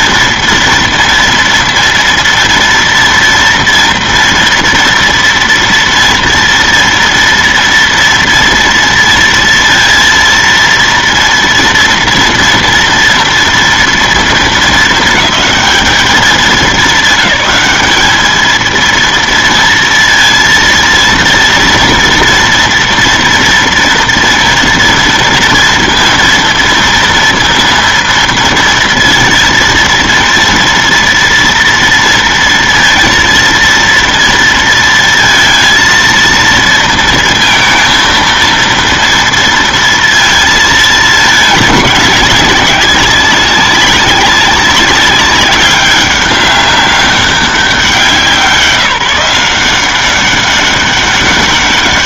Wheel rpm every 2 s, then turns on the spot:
230, 230, 230, 230, 230, 230, 230, 220, 200, 220, 230, 240, 230, 230, 230, 230, 230, 230, 230, 230, 230, 200, 200, 200, 180, 190.
none